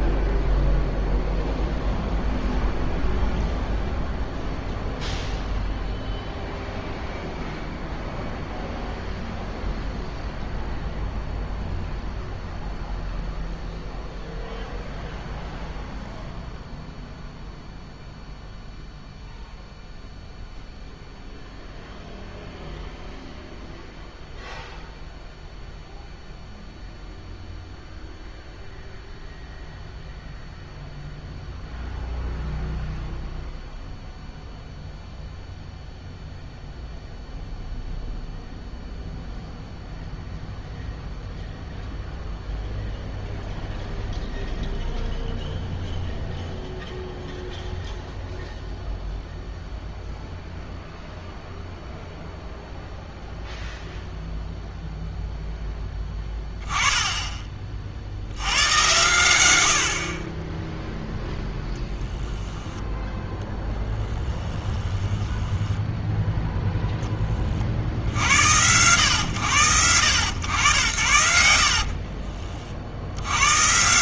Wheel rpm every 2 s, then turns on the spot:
0, 0, 0, 0, 0, 0, 0, 0, 0, 0, 0, 0, 0, 0, 0, 0, 0, 0, 0, 0, 0, 0, 0, 0, 0, 0, 0, 0, 10, 110, 10, 10, 10, 0, 100, 90, 60.
64-66